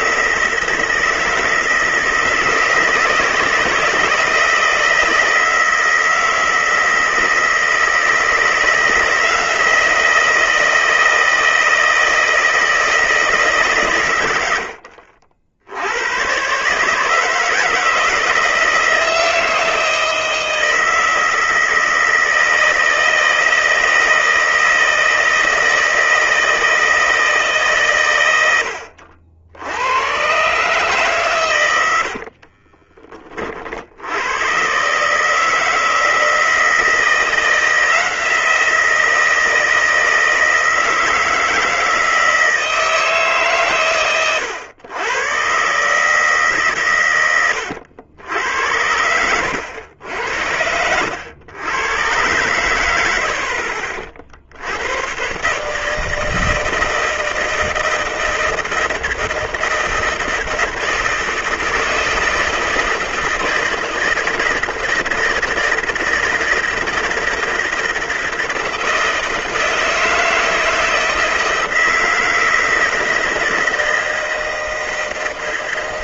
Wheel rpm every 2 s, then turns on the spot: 160, 160, 160, 160, 160, 160, 160, 80, 140, 160, 160, 160, 160, 160, 90, 130, 40, 120, 160, 170, 160, 160, 100, 140, 90, 80, 90, 70, 160, 160, 160, 160, 160, 160, 160, 160, 160, 160.
32-34